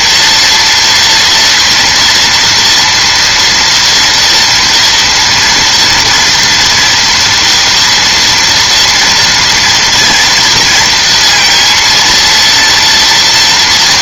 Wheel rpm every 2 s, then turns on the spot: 230, 240, 240, 230, 230, 230, 230.
none